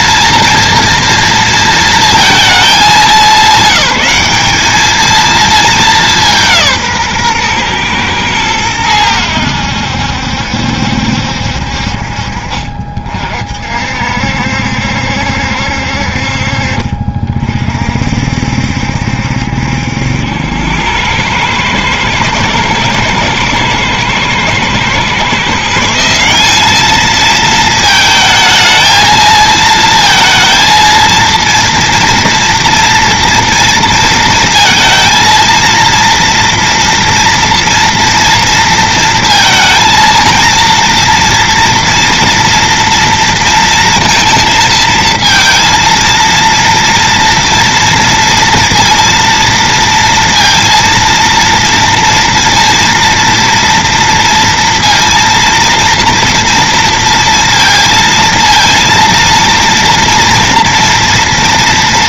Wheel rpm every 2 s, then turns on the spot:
230, 200, 200, 170, 110, 70, 50, 70, 50, 60, 90, 120, 120, 200, 220, 220, 230, 230, 230, 230, 230, 230, 230, 230, 230, 230, 230, 230, 230, 230, 230.
none